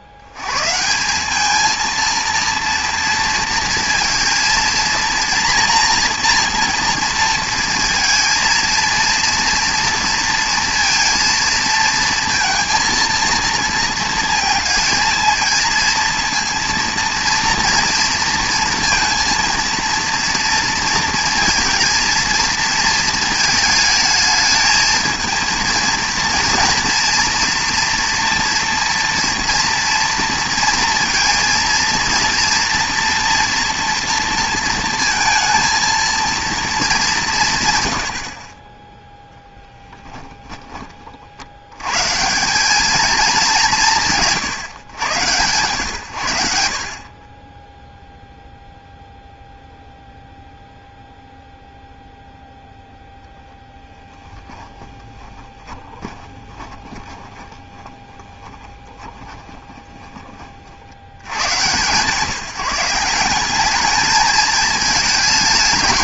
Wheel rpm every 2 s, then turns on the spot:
130, 230, 230, 230, 230, 230, 230, 230, 230, 230, 230, 230, 220, 230, 230, 230, 230, 230, 230, 30, 20, 190, 150, 70, 0, 0, 0, 20, 20, 20, 60, 170, 210.
54-60